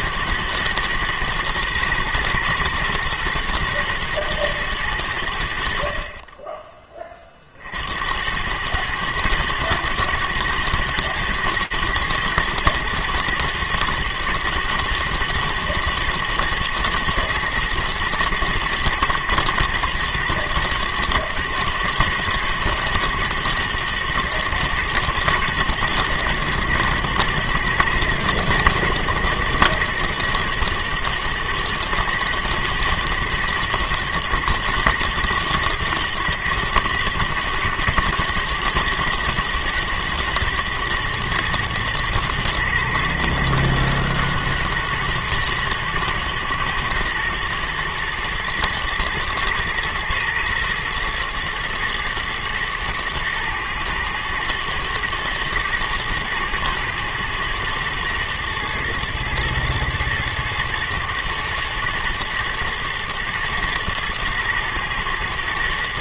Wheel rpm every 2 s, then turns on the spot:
120, 120, 110, 20, 110, 120, 110, 110, 110, 110, 120, 120, 110, 110, 110, 110, 110, 110, 110, 120, 110, 110, 110, 110, 110, 110, 110, 120, 110, 110, 110, 110, 110.
none